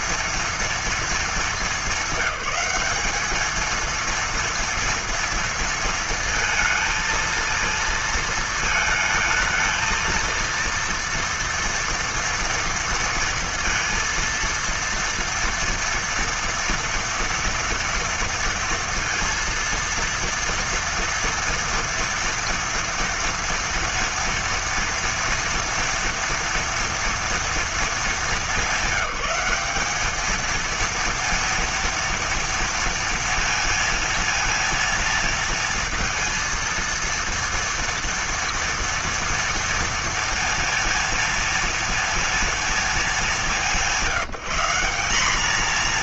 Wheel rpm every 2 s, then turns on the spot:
230, 200, 230, 230, 220, 230, 230, 230, 240, 230, 230, 230, 230, 230, 200, 220, 230, 230, 230, 230, 230, 230, 180.
none